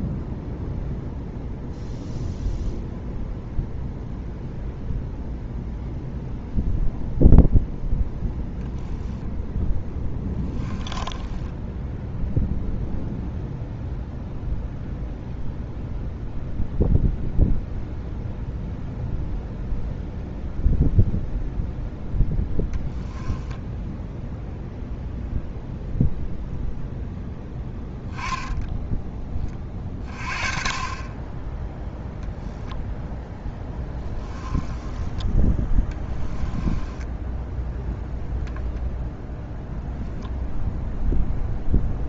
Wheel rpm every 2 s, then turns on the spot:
0, 0, 0, 0, 0, 10, 0, 0, 0, 0, 0, 0, 0, 0, 0, 30, 10, 10, 20, 0, 0.
10-12 36-38